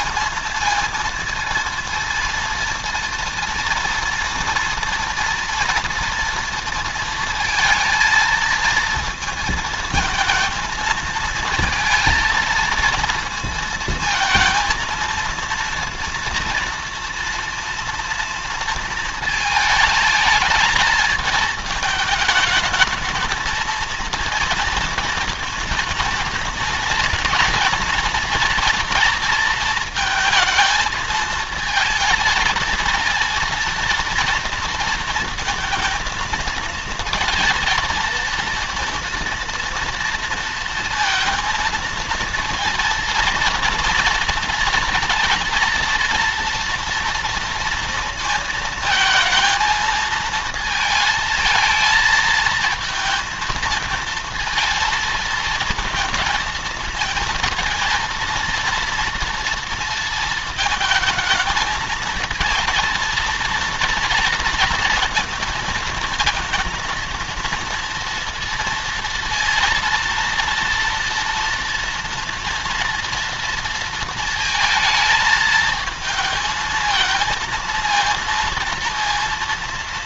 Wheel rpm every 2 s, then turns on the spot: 230, 230, 230, 230, 230, 220, 230, 230, 240, 230, 220, 220, 230, 230, 230, 220, 230, 230, 220, 230, 230, 230, 230, 230, 220, 230, 220, 220, 220, 230, 220, 230, 230, 230, 230, 230, 230, 220, 230, 230.
none